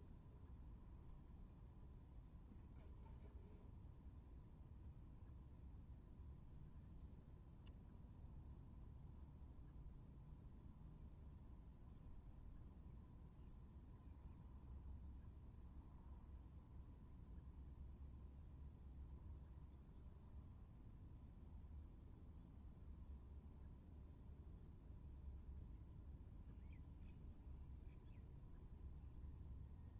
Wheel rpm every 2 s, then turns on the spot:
0, 0, 0, 0, 0, 0, 0, 0, 0, 0, 0, 0, 0, 0, 0.
none